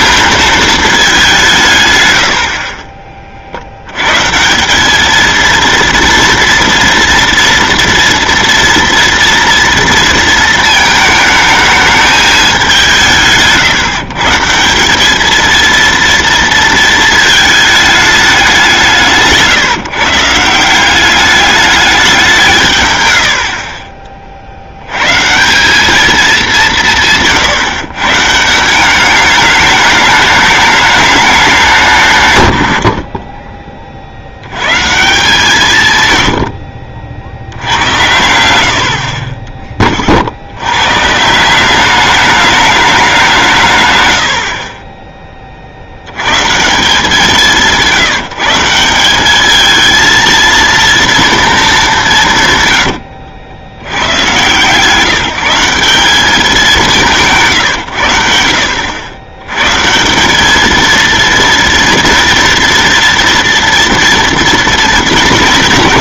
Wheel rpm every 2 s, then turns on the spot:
220, 50, 170, 230, 230, 220, 200, 170, 230, 180, 170, 150, 80, 180, 180, 210, 90, 120, 70, 80, 100, 210, 50, 160, 170, 230, 120, 140, 190, 80, 220, 230, 230.
none